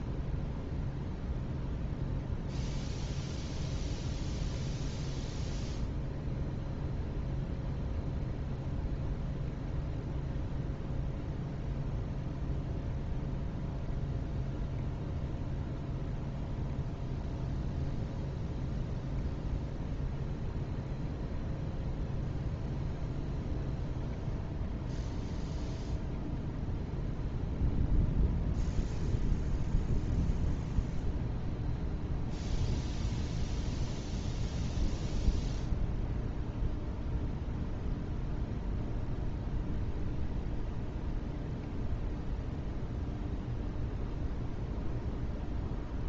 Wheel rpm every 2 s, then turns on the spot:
0, 0, 0, 0, 0, 0, 0, 0, 0, 0, 0, 0, 0, 0, 0, 0, 0, 0, 0, 0, 0, 0, 0.
none